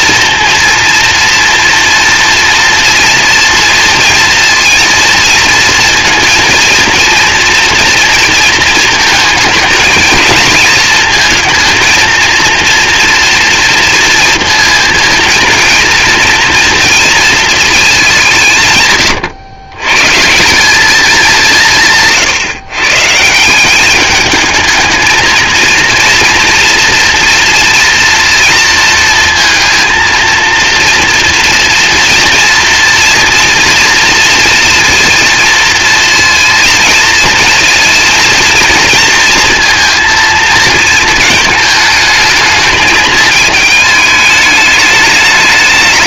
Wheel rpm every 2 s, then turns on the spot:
230, 230, 230, 230, 220, 230, 230, 230, 230, 120, 200, 150, 220, 230, 230, 230, 240, 230, 230, 230, 220, 220, 210.
none